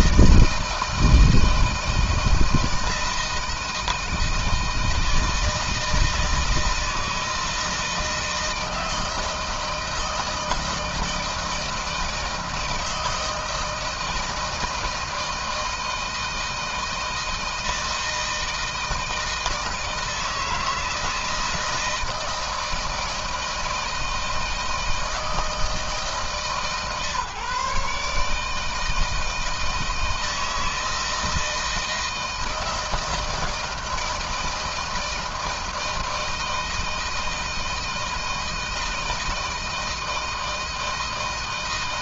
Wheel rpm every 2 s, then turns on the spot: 160, 160, 160, 160, 160, 160, 160, 160, 160, 160, 160, 160, 160, 150, 160, 160, 160, 160, 160, 160, 160.
none